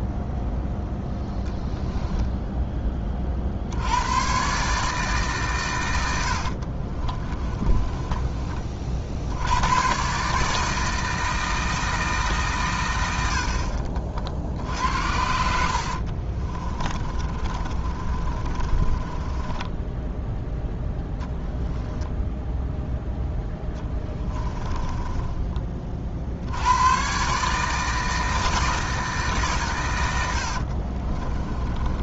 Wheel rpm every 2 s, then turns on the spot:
0, 20, 150, 40, 40, 160, 110, 70, 30, 30, 10, 10, 20, 110, 160, 50.
6-8 16-20 24-26 30-32